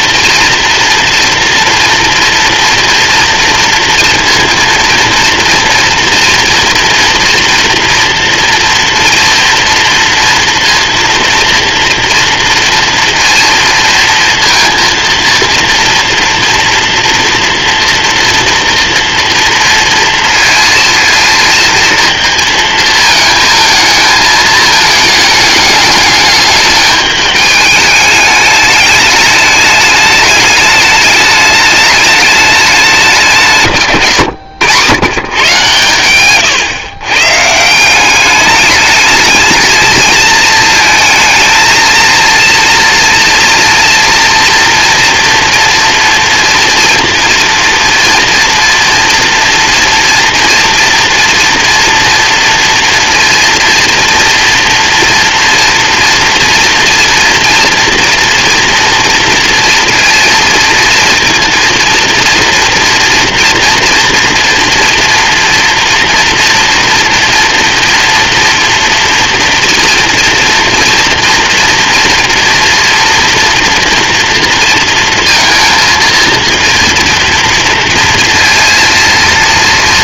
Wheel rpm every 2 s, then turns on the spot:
230, 240, 230, 230, 240, 240, 230, 230, 230, 230, 230, 230, 220, 210, 210, 210, 180, 130, 130, 210, 220, 230, 230, 230, 240, 230, 230, 240, 230, 230, 230, 230, 240, 240, 240, 230, 240, 230, 230, 230.
none